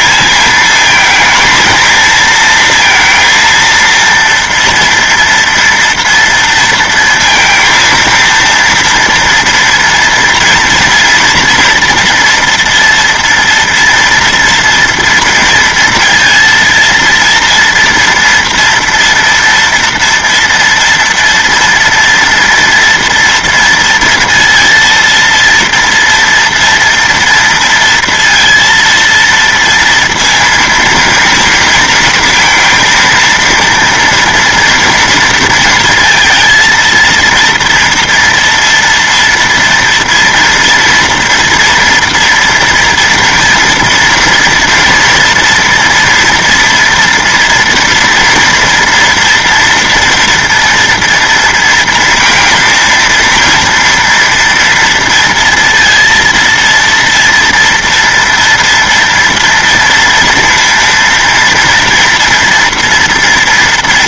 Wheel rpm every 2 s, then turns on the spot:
220, 230, 230, 230, 230, 240, 230, 240, 230, 230, 230, 230, 230, 230, 230, 230, 230, 230, 230, 230, 230, 230, 240, 230, 240, 230, 230, 230, 230, 230, 230, 240.
none